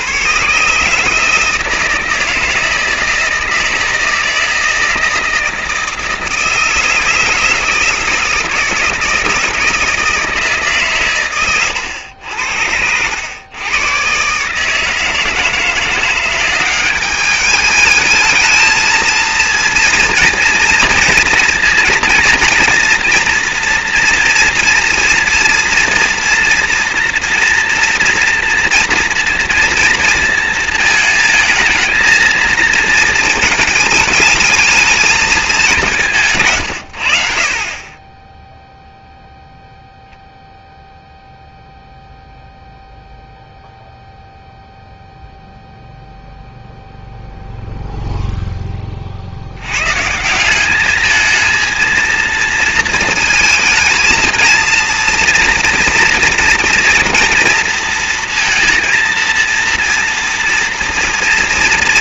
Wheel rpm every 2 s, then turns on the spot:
140, 160, 160, 170, 160, 150, 80, 150, 190, 220, 230, 240, 240, 230, 230, 220, 220, 220, 130, 0, 0, 0, 0, 0, 0, 190, 230, 230, 230, 230, 230.
36-38